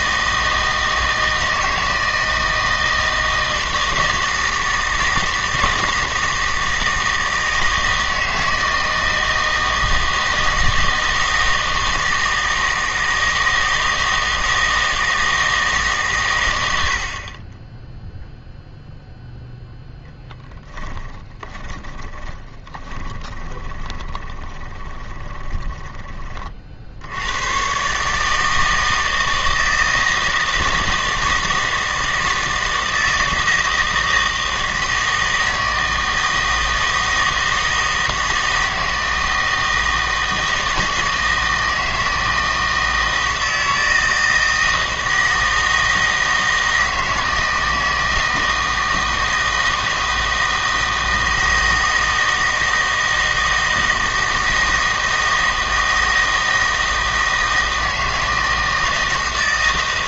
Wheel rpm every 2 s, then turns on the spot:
160, 160, 160, 160, 160, 160, 160, 160, 90, 0, 10, 20, 20, 50, 160, 160, 160, 160, 160, 160, 160, 160, 160, 160, 160, 160, 160, 160, 160, 160.
20-26